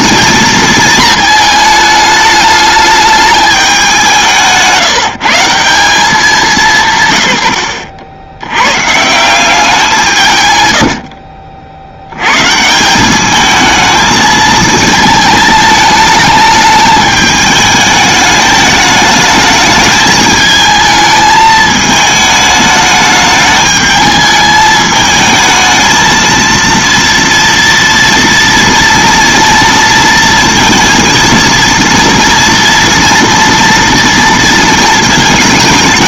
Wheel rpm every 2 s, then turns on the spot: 220, 210, 160, 160, 120, 100, 160, 220, 210, 210, 220, 210, 220, 230, 230, 230, 240, 230.
none